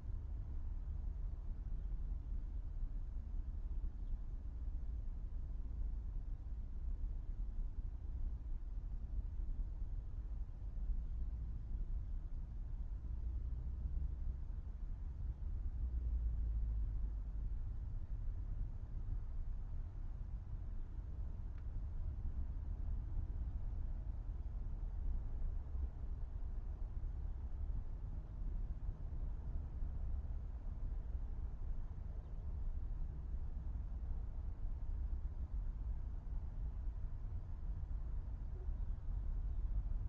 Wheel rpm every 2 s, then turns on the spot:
0, 0, 0, 0, 0, 0, 0, 0, 0, 0, 0, 0, 0, 0, 0, 0, 0, 0, 0, 0.
none